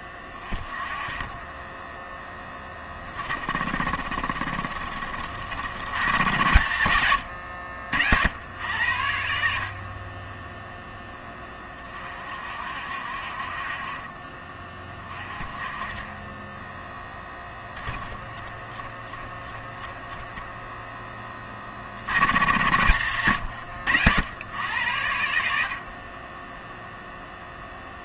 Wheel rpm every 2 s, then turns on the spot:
30, 20, 40, 110, 80, 0, 50, 30, 0, 10, 0, 90, 80, 0.
none